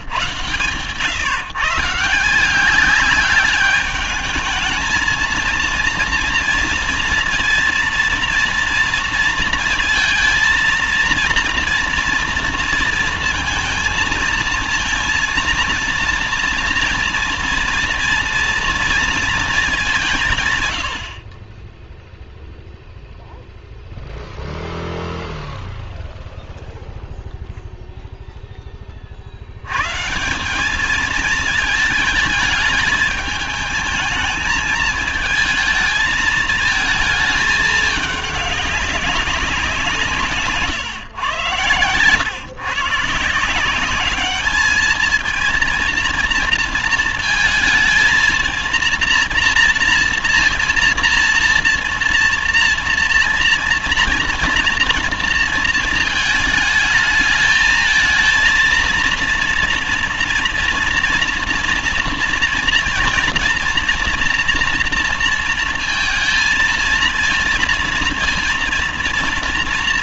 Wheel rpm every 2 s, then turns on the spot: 140, 180, 220, 230, 230, 230, 230, 230, 230, 230, 130, 0, 0, 0, 10, 200, 220, 220, 220, 200, 150, 130, 220, 230, 230, 230, 230, 230, 220, 230, 230, 230, 230, 220, 230.
none